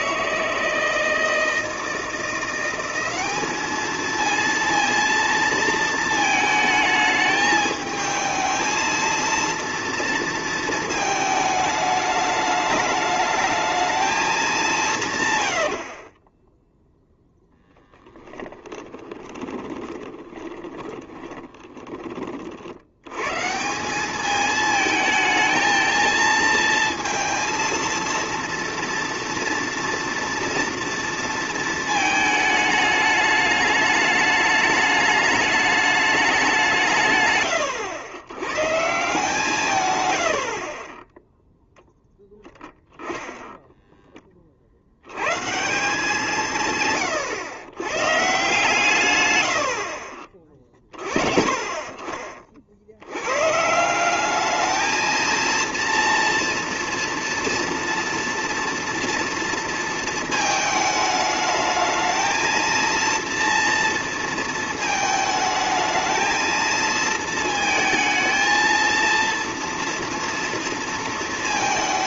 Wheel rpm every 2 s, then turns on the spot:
160, 180, 230, 220, 220, 230, 210, 180, 10, 20, 20, 60, 220, 220, 230, 230, 220, 210, 170, 110, 50, 10, 60, 130, 150, 40, 60, 220, 230, 230, 220, 230, 220, 220, 230, 230.
18-22